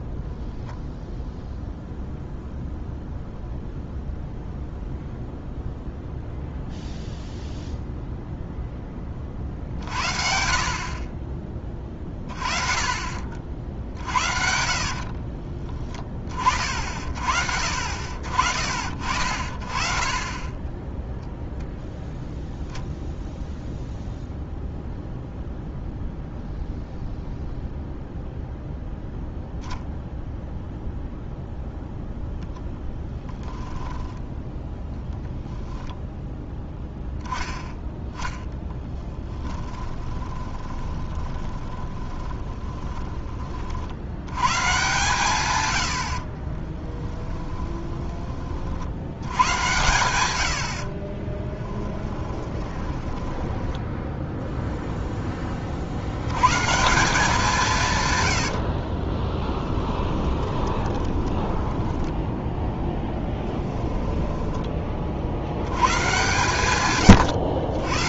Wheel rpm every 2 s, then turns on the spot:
0, 0, 0, 0, 10, 50, 40, 50, 40, 50, 10, 0, 0, 0, 0, 0, 0, 0, 10, 10, 20, 10, 130, 30, 60, 60, 10, 0, 150, 60, 30, 10, 20, 130.
14-16 38-44 46-48 52-54 58-62 66-68